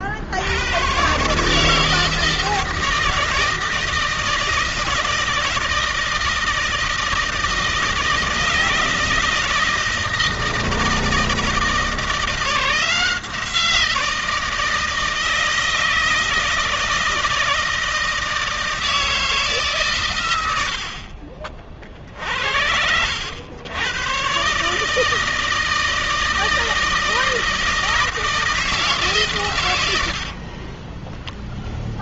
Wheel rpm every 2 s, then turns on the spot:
120, 160, 160, 160, 160, 160, 170, 160, 160, 160, 70, 80, 150, 160, 150, 20.
30-32